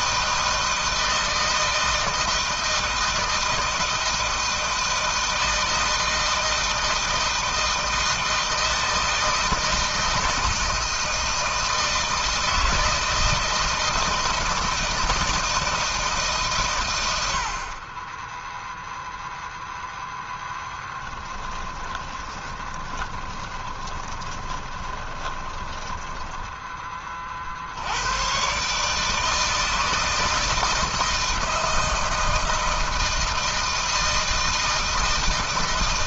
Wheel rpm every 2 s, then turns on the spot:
160, 160, 160, 160, 160, 160, 160, 160, 140, 10, 10, 30, 20, 20, 120, 160, 160, 160.
22-28